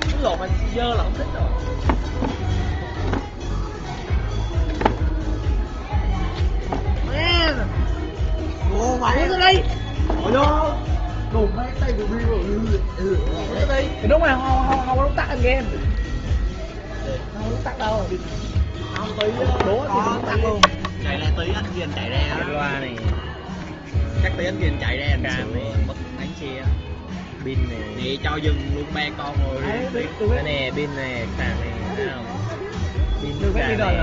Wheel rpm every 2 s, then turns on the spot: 0, 0, 0, 0, 0, 0, 0, 0, 0, 0, 0, 0, 0, 0, 0, 0, 0.
none